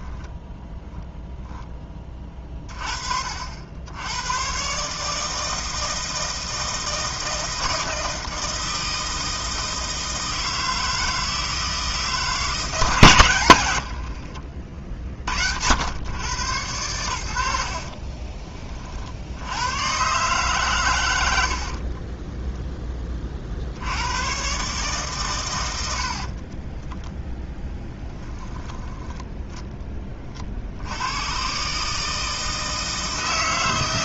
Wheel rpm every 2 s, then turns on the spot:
10, 30, 130, 160, 160, 160, 160, 50, 100, 40, 130, 20, 120, 30, 10, 50, 160.
22-24 26-30